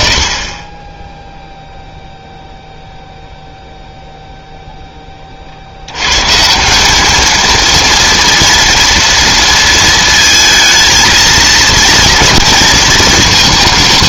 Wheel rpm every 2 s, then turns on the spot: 30, 0, 0, 170, 230, 220, 230.
none